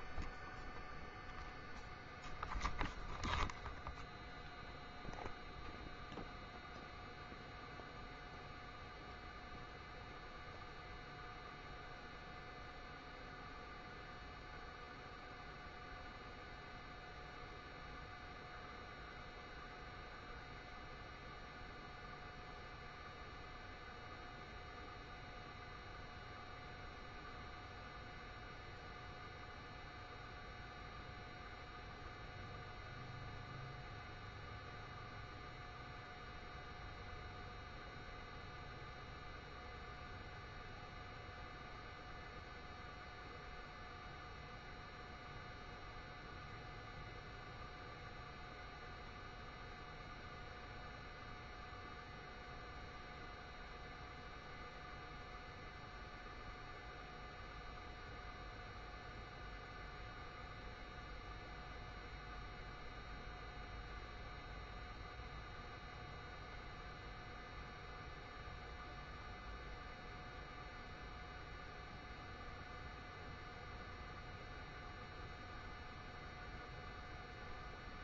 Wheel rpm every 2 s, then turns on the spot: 0, 0, 0, 0, 0, 0, 0, 0, 0, 0, 0, 0, 0, 0, 0, 0, 0, 0, 0, 0, 0, 0, 0, 0, 0, 0, 0, 0, 0, 0, 0, 0, 0, 0, 0, 0, 0, 0, 0.
none